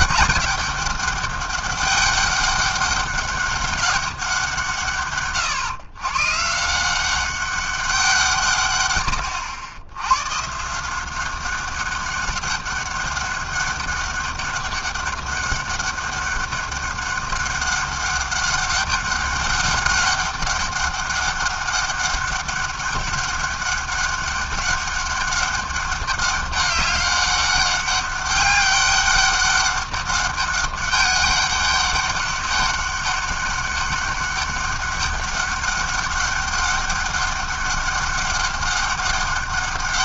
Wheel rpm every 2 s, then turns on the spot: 200, 200, 150, 190, 90, 190, 200, 200, 200, 200, 200, 200, 200, 200, 200, 200, 200, 200, 200, 200.
none